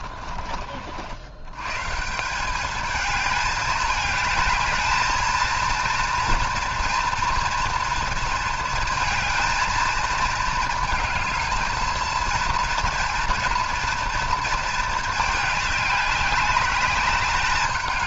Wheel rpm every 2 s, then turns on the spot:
50, 200, 220, 230, 220, 220, 230, 230, 200.
none